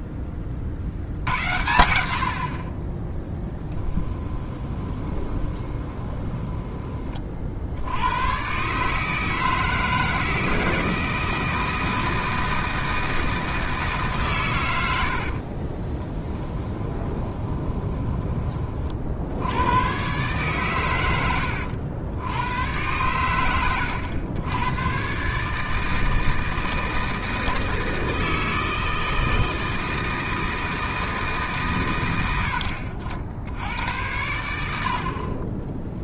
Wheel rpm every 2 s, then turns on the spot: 50, 50, 20, 20, 130, 160, 160, 100, 10, 30, 130, 100, 110, 160, 160, 160, 50, 80.
4-8 16-18